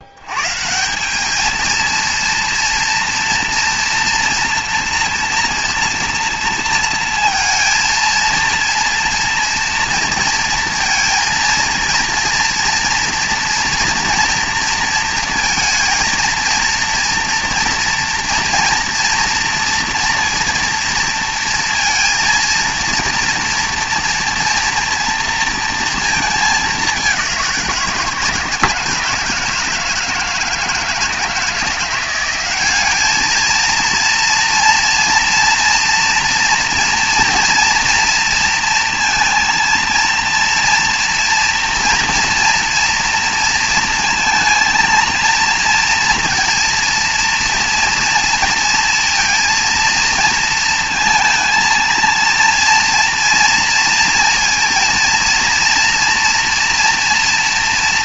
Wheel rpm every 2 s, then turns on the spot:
100, 230, 230, 230, 230, 230, 230, 230, 230, 230, 230, 230, 230, 220, 160, 160, 180, 230, 230, 230, 230, 240, 230, 230, 230, 230, 230, 230, 230.
none